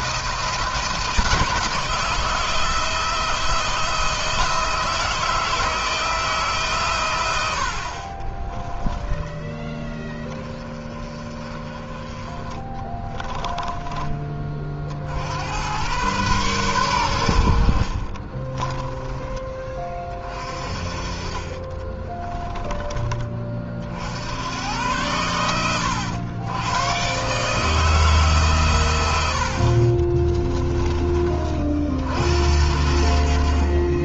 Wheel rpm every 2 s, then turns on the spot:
160, 160, 160, 130, 20, 30, 20, 50, 100, 20, 30, 20, 90, 110, 120, 30, 70.
12-14 20-22